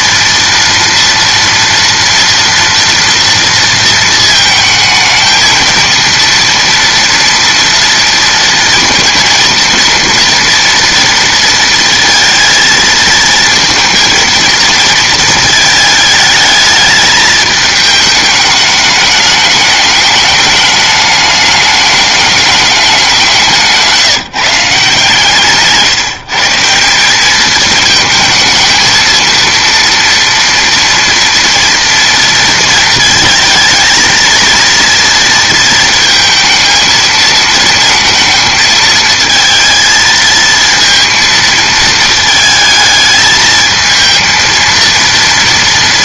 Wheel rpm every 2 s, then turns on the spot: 230, 230, 220, 230, 230, 230, 220, 230, 220, 210, 210, 210, 160, 180, 220, 230, 230, 230, 220, 220, 230, 220, 230.
none